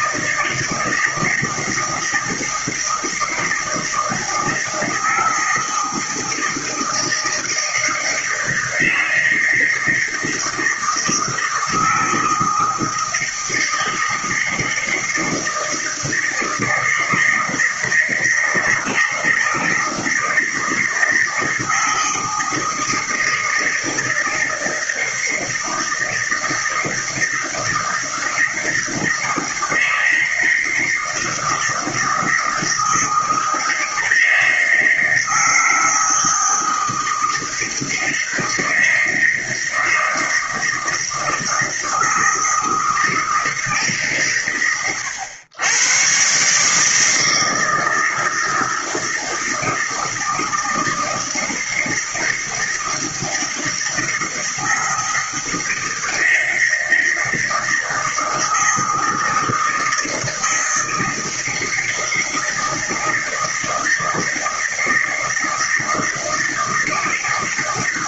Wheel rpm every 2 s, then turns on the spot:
160, 160, 160, 160, 160, 160, 160, 160, 160, 160, 160, 160, 160, 160, 160, 160, 160, 160, 160, 160, 160, 160, 100, 150, 160, 160, 160, 160, 160, 160, 160, 160, 160, 160.
none